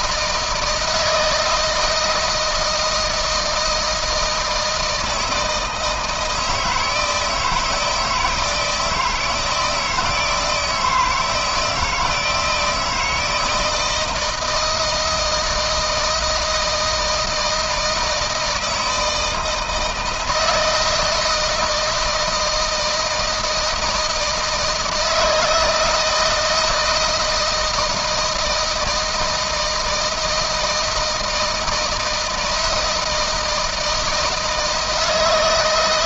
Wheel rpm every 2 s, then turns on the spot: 160, 160, 160, 160, 160, 160, 160, 160, 160, 160, 160, 160, 160, 160, 160, 160, 170, 160.
none